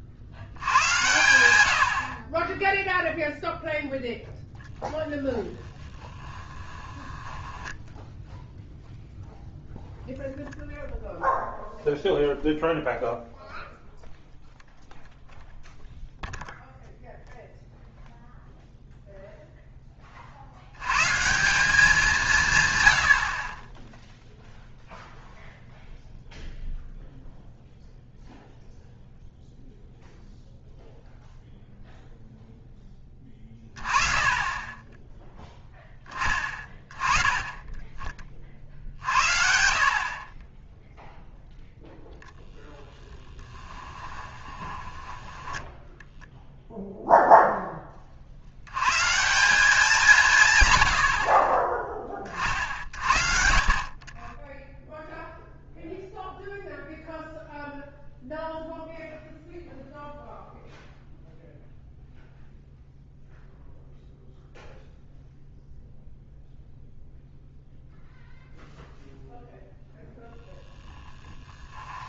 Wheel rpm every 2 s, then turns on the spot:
100, 10, 10, 20, 0, 0, 0, 0, 0, 0, 100, 130, 0, 0, 0, 0, 10, 10, 20, 50, 20, 0, 20, 0, 90, 120, 50, 0, 0, 0, 0, 0, 0, 0, 0, 10.
6-8 44-46